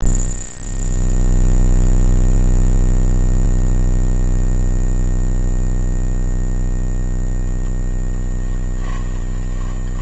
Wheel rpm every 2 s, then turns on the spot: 0, 0, 0, 0, 30.
8-10